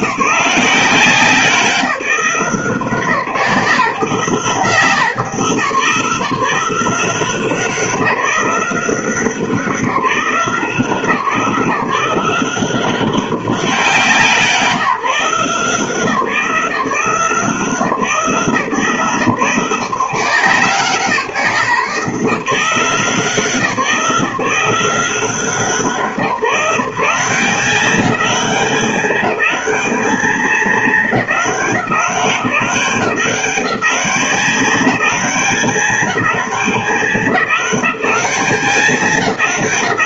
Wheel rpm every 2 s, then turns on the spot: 170, 160, 170, 180, 180, 170, 180, 170, 170, 150, 160, 170, 170, 180, 200, 210, 190, 200, 190, 200.
none